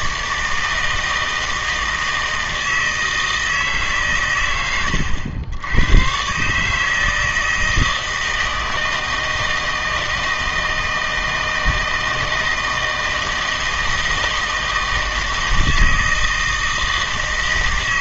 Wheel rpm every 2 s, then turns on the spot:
160, 160, 100, 140, 160, 160, 160, 160, 160.
none